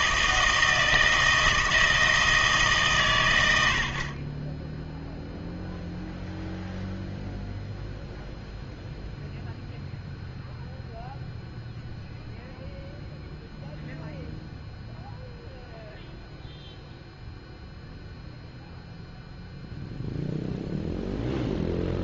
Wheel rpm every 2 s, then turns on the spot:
160, 150, 10, 0, 0, 0, 0, 0, 0, 0, 0.
none